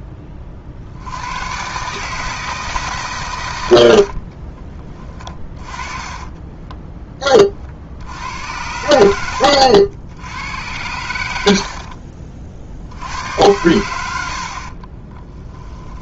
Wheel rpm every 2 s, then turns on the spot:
30, 150, 30, 20, 80, 80, 60, 50.
4-8